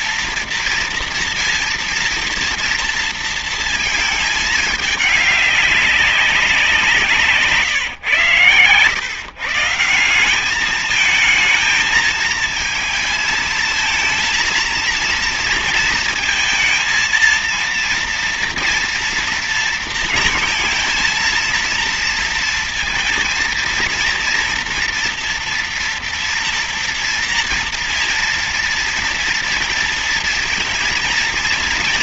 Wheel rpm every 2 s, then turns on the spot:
230, 230, 210, 180, 140, 200, 220, 230, 230, 230, 220, 230, 240, 230, 230, 230.
none